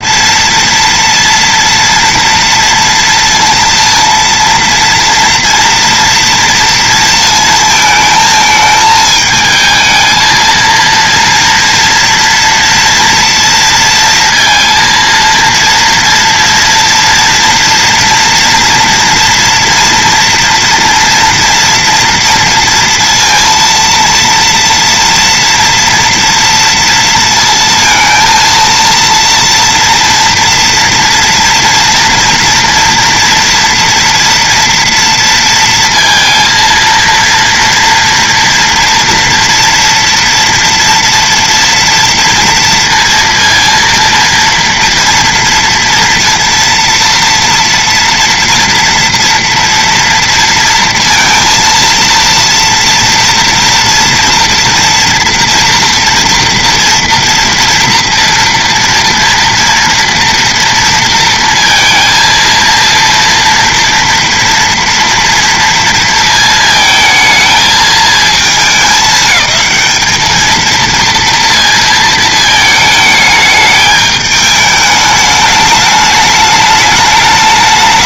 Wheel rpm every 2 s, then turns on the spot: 230, 230, 230, 230, 220, 230, 230, 230, 230, 230, 230, 230, 230, 230, 230, 230, 240, 230, 230, 240, 230, 230, 230, 230, 230, 230, 230, 240, 230, 230, 230, 230, 230, 220, 200, 230, 220, 210, 210.
none